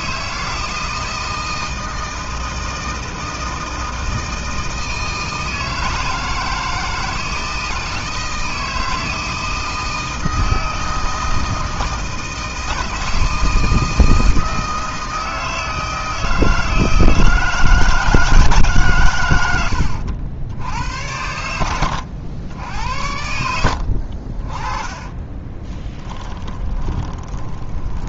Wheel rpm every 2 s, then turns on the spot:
160, 160, 160, 160, 160, 160, 160, 160, 160, 140, 80, 80, 30, 20.
24-28